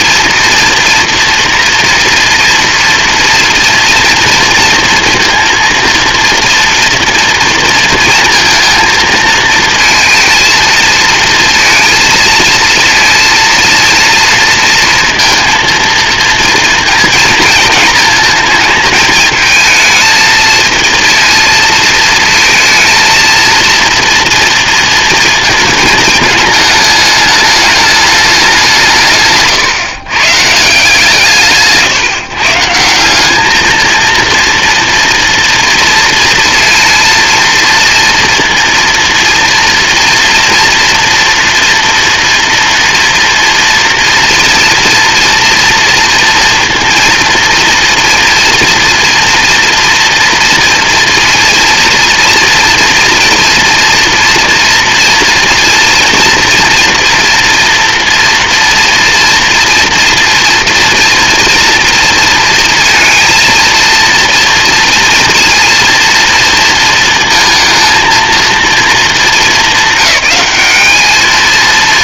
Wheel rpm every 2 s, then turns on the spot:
230, 230, 230, 230, 230, 230, 220, 230, 220, 230, 230, 230, 230, 210, 130, 140, 210, 230, 230, 230, 230, 230, 230, 230, 230, 230, 240, 240, 230, 240, 240, 230, 230, 220, 220, 220.
none